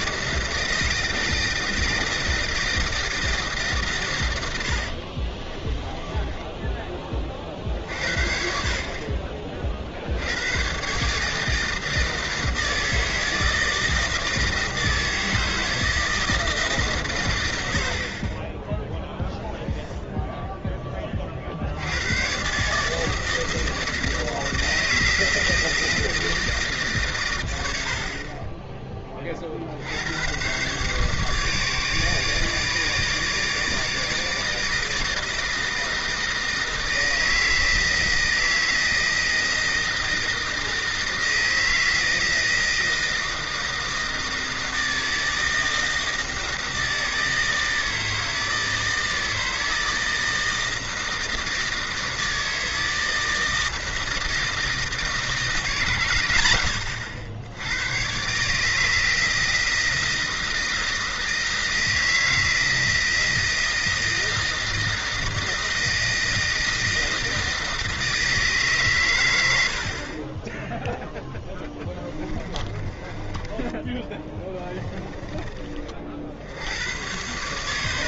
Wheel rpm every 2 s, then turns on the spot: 160, 160, 90, 10, 60, 120, 160, 160, 160, 20, 10, 140, 160, 160, 20, 120, 150, 160, 160, 160, 160, 160, 160, 160, 160, 160, 160, 160, 100, 150, 160, 160, 160, 160, 150, 10, 20, 20, 80.
4-8 72-76